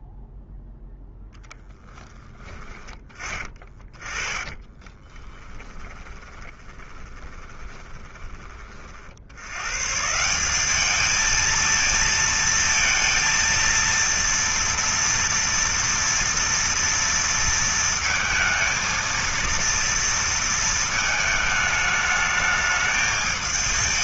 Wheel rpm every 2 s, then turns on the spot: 0, 20, 20, 20, 100, 220, 230, 230, 230, 230, 220, 210.
2-8